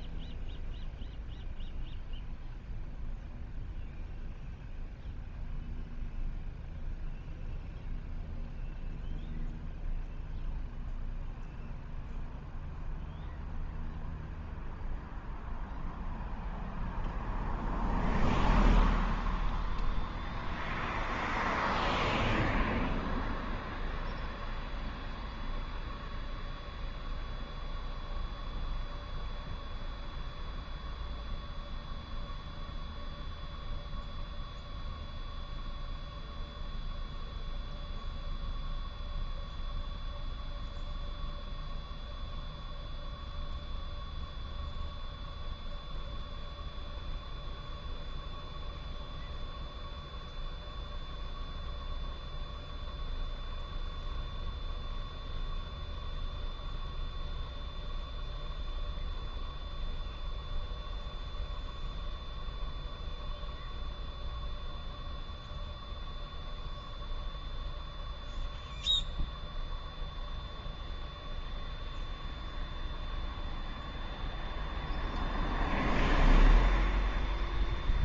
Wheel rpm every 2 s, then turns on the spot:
0, 0, 0, 0, 0, 0, 0, 0, 0, 0, 0, 0, 0, 0, 0, 0, 0, 0, 0, 0, 0, 0, 0, 0, 0, 0, 0, 0, 0, 0, 0, 0, 0, 0, 0, 0, 0, 0, 0.
none